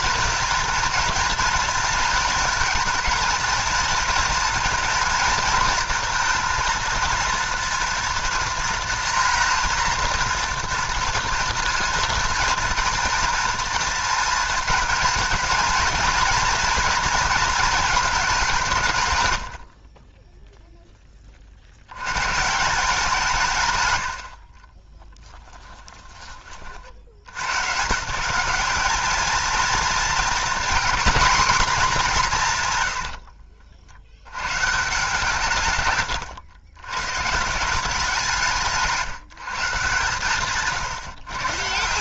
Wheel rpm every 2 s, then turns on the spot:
230, 220, 230, 230, 230, 230, 230, 220, 230, 160, 0, 160, 30, 50, 200, 250, 130, 130, 100, 150, 140.
24-26 38-40